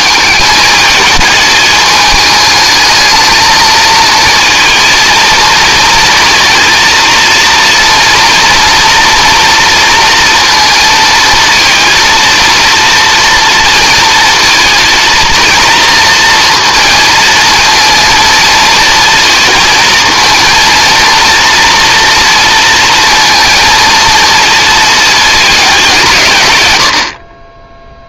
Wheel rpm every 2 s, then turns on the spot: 220, 220, 230, 230, 230, 230, 230, 230, 230, 230, 230, 230, 220, 100.
none